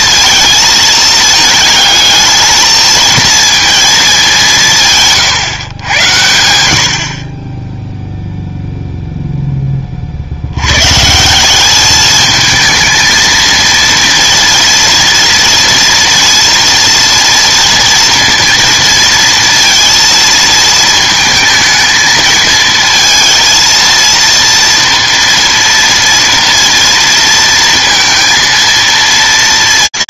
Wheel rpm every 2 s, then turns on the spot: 230, 220, 160, 80, 0, 110, 220, 230, 230, 230, 220, 220, 240, 230, 230.
none